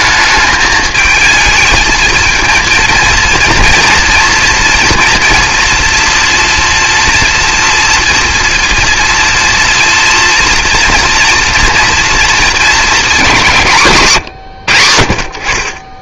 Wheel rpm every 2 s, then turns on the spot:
220, 230, 230, 230, 230, 230, 230, 90.
none